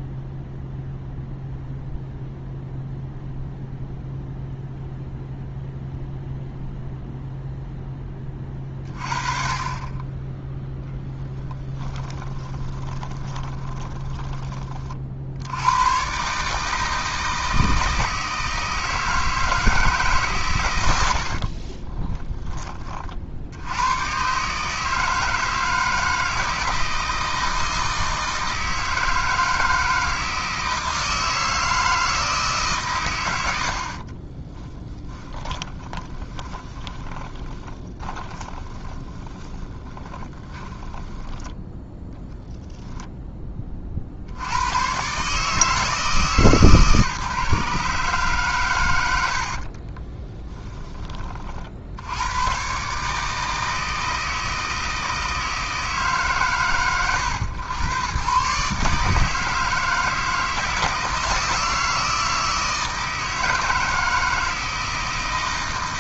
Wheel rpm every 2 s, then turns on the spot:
0, 0, 0, 0, 30, 10, 20, 40, 150, 160, 110, 30, 150, 160, 160, 160, 140, 20, 20, 20, 10, 0, 100, 150, 120, 10, 130, 160, 100, 140, 160, 160, 160.
12-14 34-42